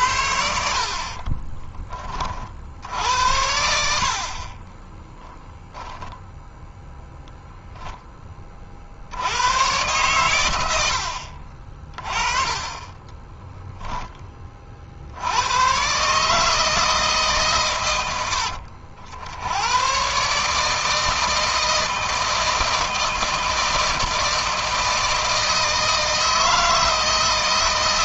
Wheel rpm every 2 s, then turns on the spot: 60, 60, 40, 0, 40, 100, 20, 30, 160, 70, 150, 160, 160, 160.
0-2 4-6